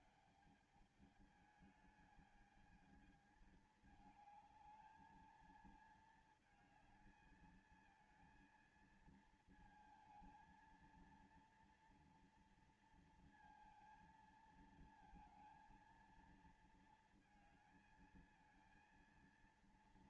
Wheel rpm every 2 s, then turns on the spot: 200, 210, 210, 220, 230, 230, 230, 230, 230, 220.
none